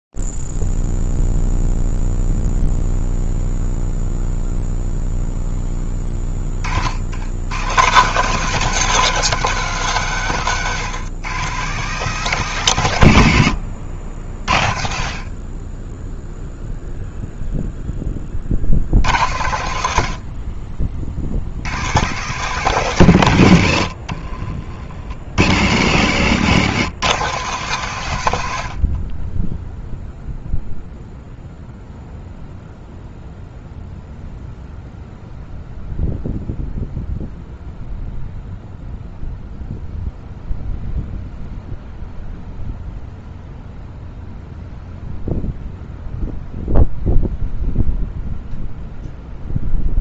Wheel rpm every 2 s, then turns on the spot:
0, 0, 0, 20, 150, 150, 160, 70, 10, 40, 70, 150, 50, 140, 100, 0, 0, 0, 0, 0, 0, 0, 0, 0, 0.
24-26